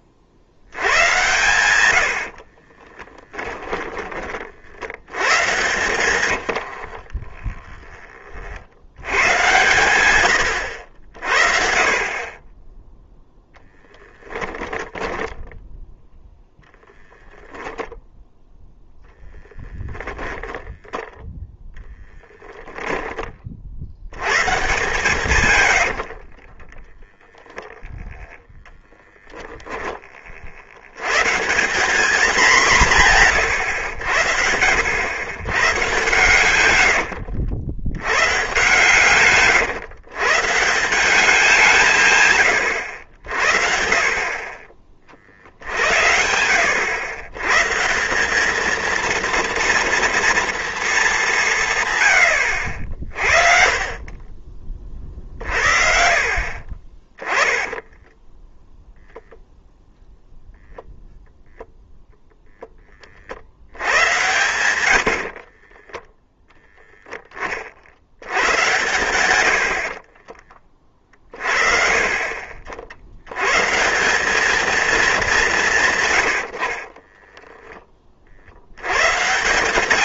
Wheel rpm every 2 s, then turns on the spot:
80, 40, 60, 70, 60, 80, 20, 10, 0, 0, 0, 10, 130, 20, 0, 70, 180, 90, 90, 140, 180, 90, 30, 90, 220, 220, 60, 30, 30, 0, 0, 10, 80, 0, 110, 30, 60, 220, 60, 90.
2-4 6-8 14-16 26-28 36-38 76-78